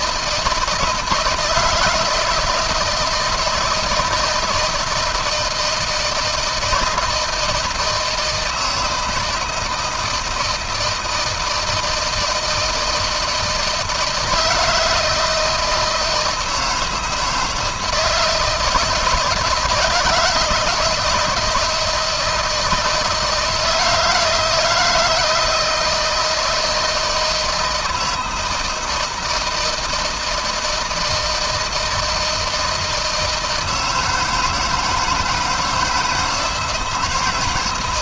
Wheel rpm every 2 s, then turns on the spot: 160, 160, 160, 160, 160, 160, 160, 160, 160, 160, 170, 160, 170, 160, 160, 160, 160, 160, 170.
none